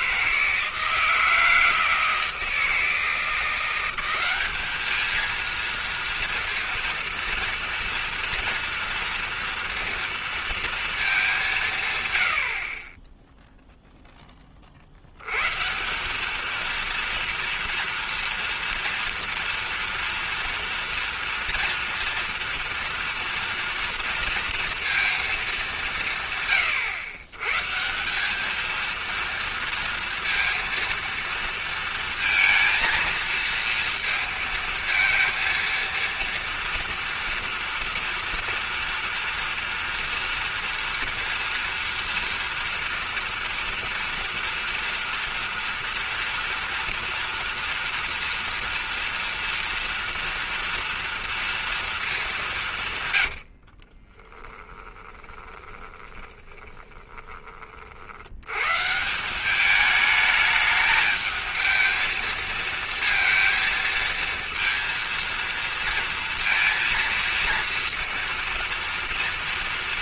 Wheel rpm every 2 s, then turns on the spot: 160, 160, 210, 230, 230, 230, 60, 40, 220, 230, 230, 230, 230, 120, 210, 230, 230, 230, 230, 230, 230, 230, 240, 230, 230, 230, 180, 20, 20, 130, 220, 230, 230, 230, 230.
54-58